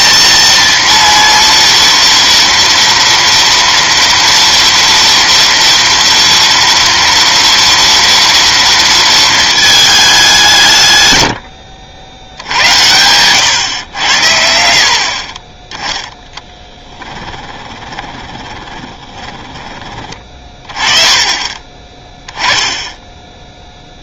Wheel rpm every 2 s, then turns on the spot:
230, 240, 230, 230, 230, 100, 100, 60, 10, 20, 30, 10.
16-20